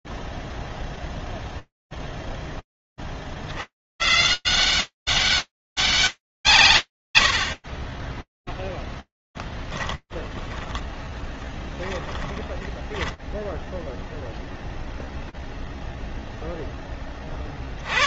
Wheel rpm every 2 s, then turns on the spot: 30, 190, 140, 0, 10, 10, 0, 40, 180.
8-10